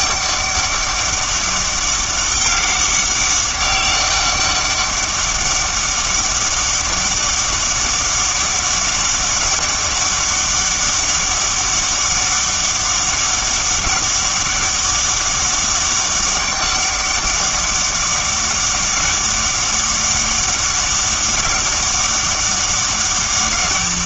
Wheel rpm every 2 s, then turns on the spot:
200, 200, 200, 200, 200, 200, 200, 200, 200, 200, 200, 200.
none